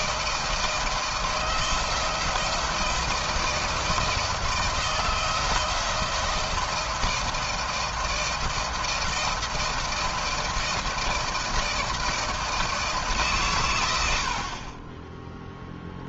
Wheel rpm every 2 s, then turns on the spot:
160, 160, 160, 160, 160, 160, 160, 30.
none